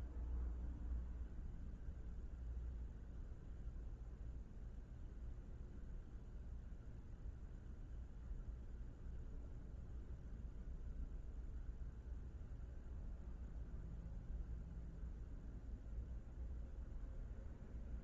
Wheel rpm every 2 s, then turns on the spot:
0, 0, 0, 0, 0, 0, 0, 0, 0.
none